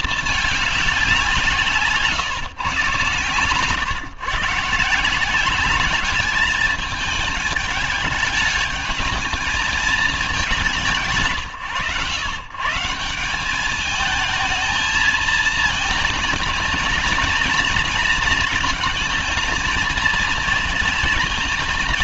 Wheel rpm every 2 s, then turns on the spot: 210, 140, 150, 210, 210, 200, 140, 220, 230, 220, 230.
none